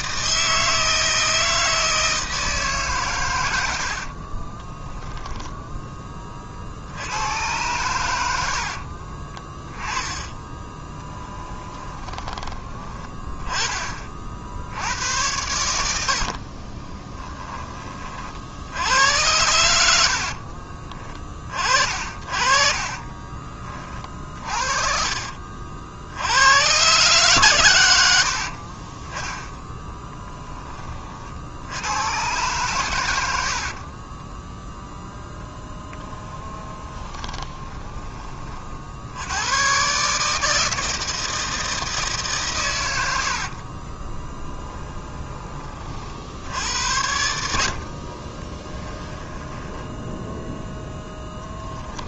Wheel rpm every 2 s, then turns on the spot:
160, 150, 10, 60, 60, 10, 10, 80, 30, 80, 40, 40, 30, 110, 50, 20, 110, 0, 10, 40, 160, 120, 20, 80, 20, 0.
4-6 8-12 16-18 20-26 36-38 44-46 48-50